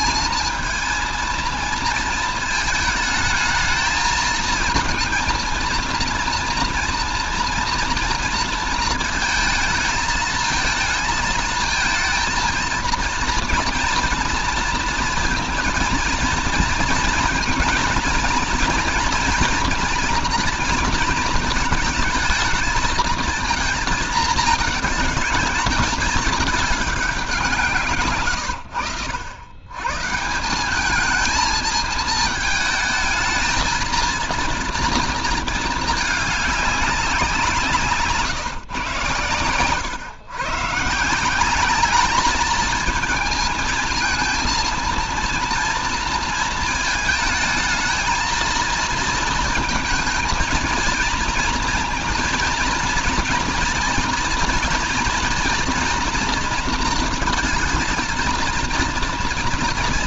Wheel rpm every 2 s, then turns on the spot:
220, 220, 230, 240, 230, 220, 230, 230, 230, 230, 230, 230, 220, 200, 100, 200, 220, 230, 190, 120, 150, 220, 230, 230, 230, 230, 230, 240, 230, 230.
none